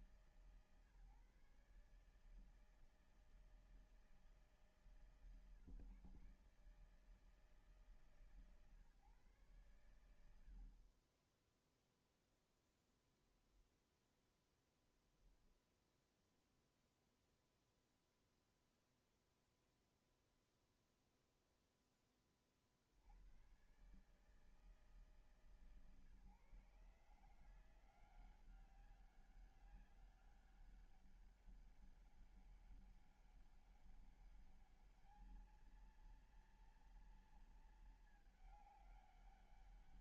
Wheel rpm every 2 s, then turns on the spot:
150, 160, 150, 150, 130, 40, 0, 0, 0, 0, 0, 50, 150, 140, 190, 200, 200, 210, 230, 210.
none